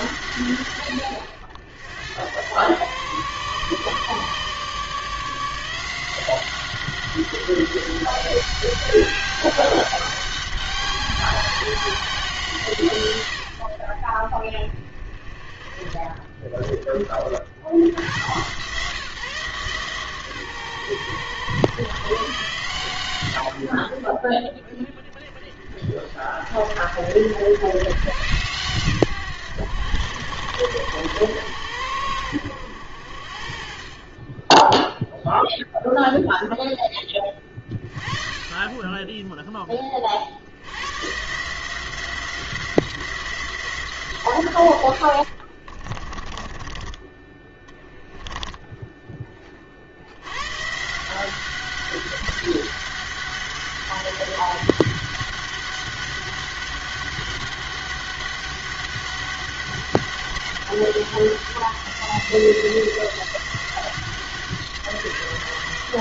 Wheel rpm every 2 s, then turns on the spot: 120, 110, 150, 180, 200, 200, 160, 40, 20, 140, 120, 140, 30, 60, 130, 90, 90, 10, 0, 30, 70, 180, 120, 30, 10, 120, 200, 200, 200, 200, 200, 180, 180.
46-50